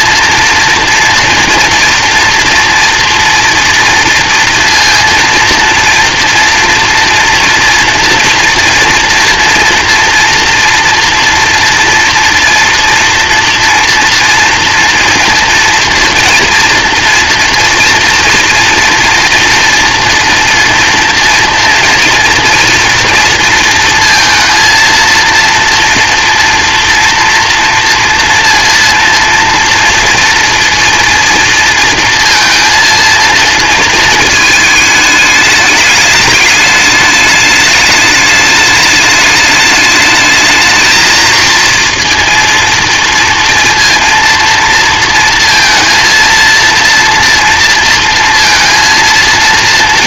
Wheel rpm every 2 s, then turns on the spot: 230, 230, 230, 230, 230, 240, 230, 230, 230, 230, 230, 230, 230, 230, 230, 230, 230, 220, 210, 210, 220, 230, 230, 230, 230.
none